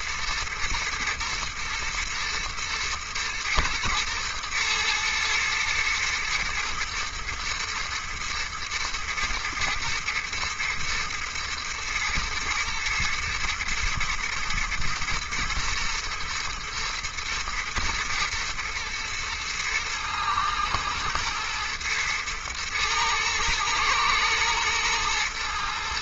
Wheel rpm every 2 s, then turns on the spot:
110, 110, 110, 120, 110, 120, 120, 120, 120, 110, 110, 110, 110.
none